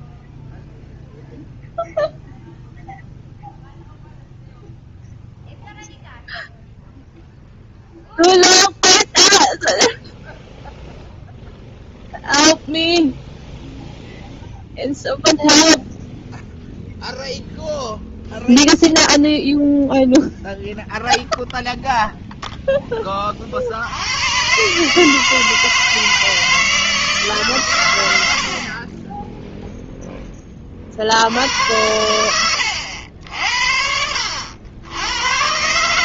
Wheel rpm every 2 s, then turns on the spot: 0, 0, 0, 0, 0, 0, 0, 0, 0, 0, 0, 0, 130, 160, 60, 20, 90, 80.
32-34